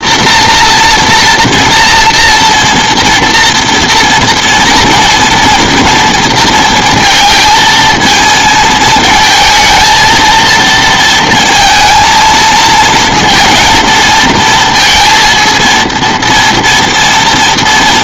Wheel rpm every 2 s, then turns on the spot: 230, 230, 230, 230, 220, 230, 230, 230, 230.
none